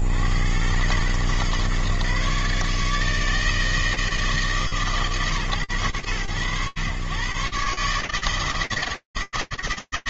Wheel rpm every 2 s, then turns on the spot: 50, 130, 150, 110, 150.
none